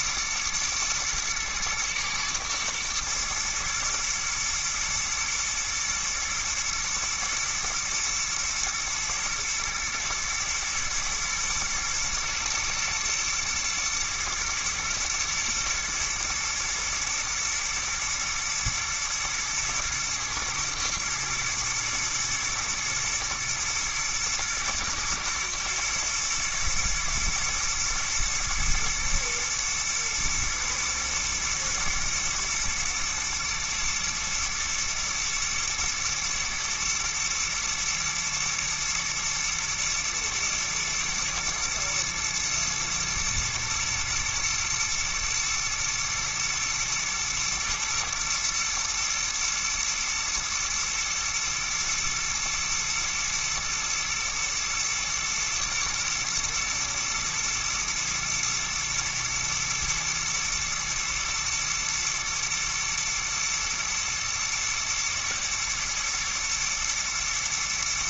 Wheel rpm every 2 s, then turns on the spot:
110, 110, 110, 110, 120, 110, 120, 110, 110, 110, 120, 120, 110, 110, 120, 120, 120, 120, 110, 110, 120, 110, 120, 120, 120, 120, 110, 110, 120, 110, 110, 110, 110, 120.
none